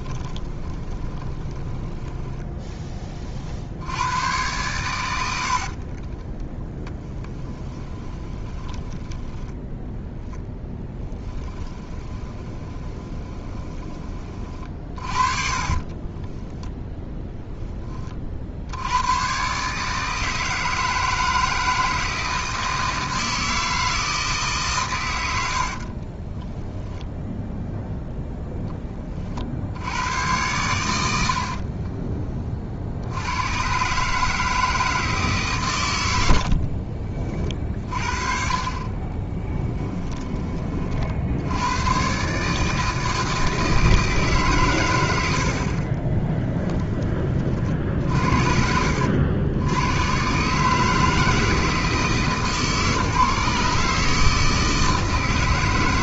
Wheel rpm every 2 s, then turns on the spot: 20, 20, 110, 40, 20, 10, 20, 30, 10, 100, 160, 160, 130, 10, 10, 90, 60, 160, 40, 30, 40, 160, 110, 20, 70, 150, 150, 160.
0-2 6-10 12-16 26-28 36-38 46-48